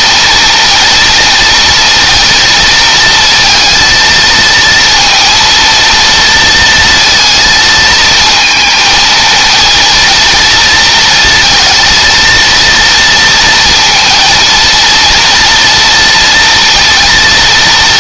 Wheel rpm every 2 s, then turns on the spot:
230, 230, 230, 230, 220, 230, 230, 230, 230.
none